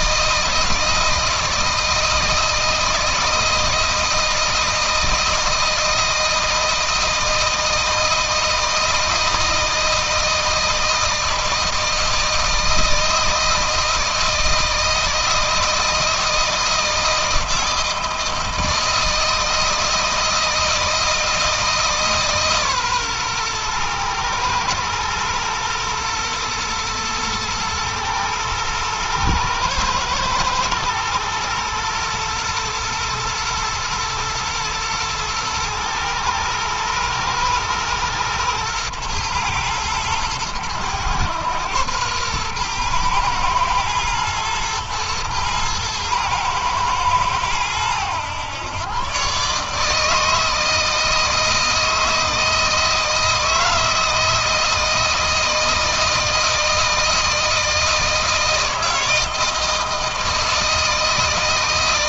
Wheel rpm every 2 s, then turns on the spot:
160, 160, 160, 160, 160, 160, 160, 160, 160, 160, 160, 130, 110, 110, 110, 110, 110, 110, 110, 110, 110, 120, 120, 110, 120, 160, 160, 160, 160, 160, 160.
none